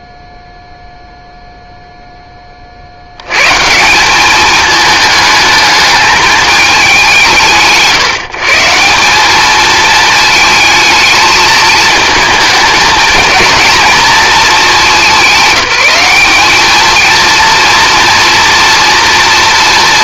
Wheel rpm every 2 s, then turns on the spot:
0, 60, 220, 170, 180, 220, 220, 200, 220, 230.
none